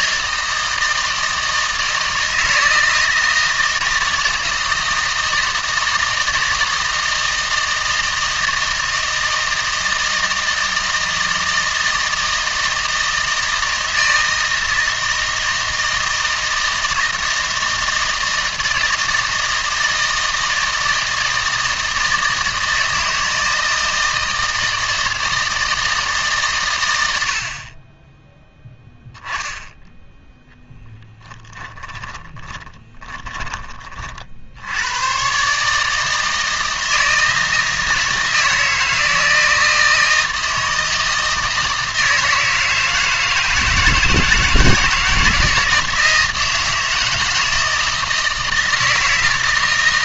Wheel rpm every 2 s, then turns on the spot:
160, 160, 160, 160, 160, 160, 160, 160, 160, 160, 160, 160, 160, 120, 10, 0, 20, 80, 160, 160, 160, 160, 160, 160, 160.
32-34